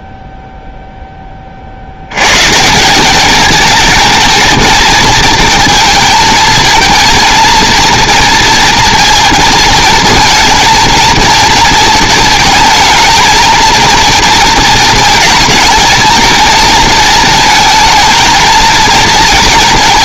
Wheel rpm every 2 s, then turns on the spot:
0, 180, 230, 220, 230, 230, 220, 230, 230, 220.
none